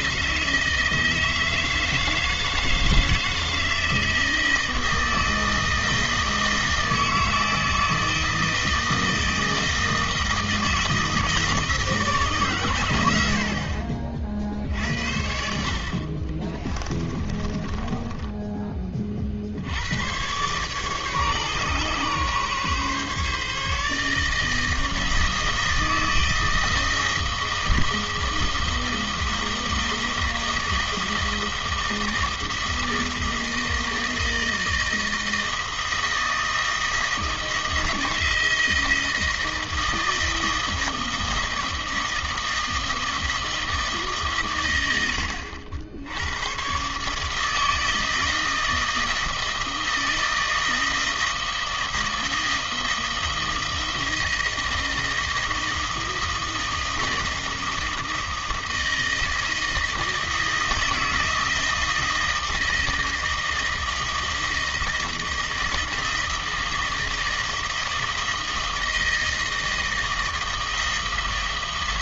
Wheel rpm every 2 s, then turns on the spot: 160, 160, 160, 160, 160, 160, 140, 50, 30, 10, 130, 140, 160, 160, 160, 160, 160, 160, 160, 160, 160, 160, 130, 100, 160, 160, 160, 160, 160, 160, 160, 160, 160, 160, 160, 160.
16-18